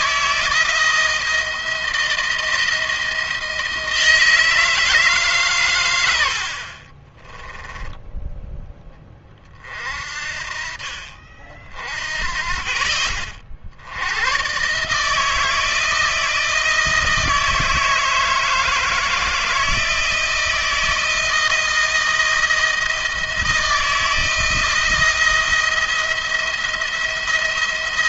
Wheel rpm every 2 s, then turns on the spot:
170, 160, 160, 30, 20, 50, 50, 140, 160, 160, 160, 160, 170, 170.
6-8